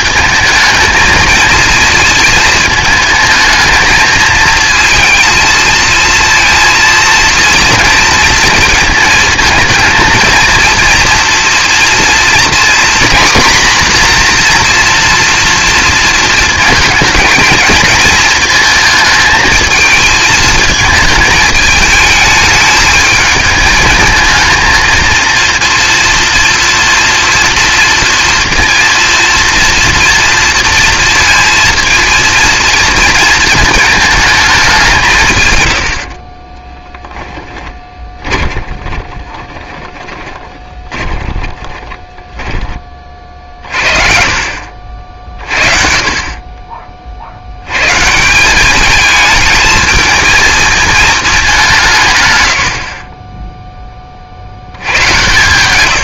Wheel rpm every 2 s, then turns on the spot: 220, 220, 230, 230, 230, 230, 250, 240, 220, 220, 220, 220, 230, 230, 230, 230, 230, 200, 20, 20, 30, 30, 60, 30, 200, 220, 100, 70.
36-42